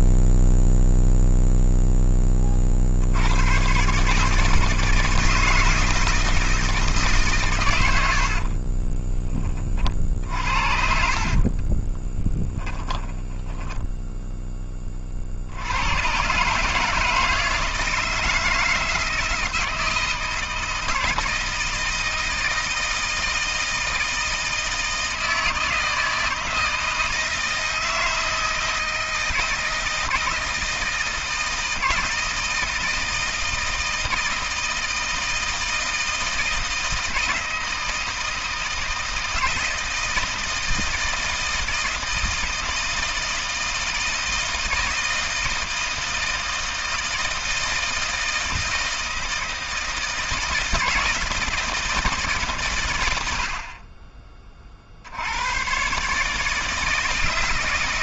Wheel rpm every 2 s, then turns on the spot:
0, 60, 160, 150, 40, 60, 10, 30, 150, 160, 160, 160, 160, 160, 160, 160, 160, 160, 160, 160, 160, 160, 170, 160, 160, 160, 100, 60, 160.
8-14